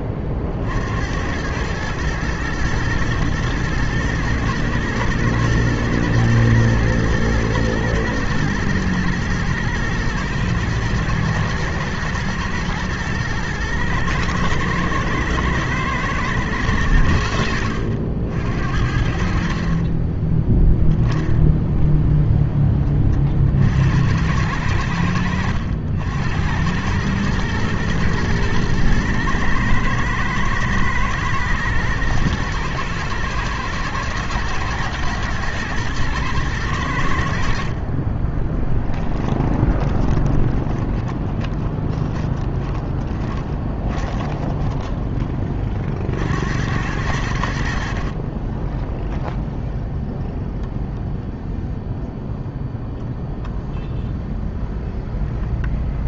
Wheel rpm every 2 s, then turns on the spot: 30, 110, 110, 120, 120, 110, 120, 110, 110, 70, 10, 10, 90, 90, 110, 110, 110, 110, 120, 10, 20, 10, 10, 70, 20, 0, 0, 0.
40-46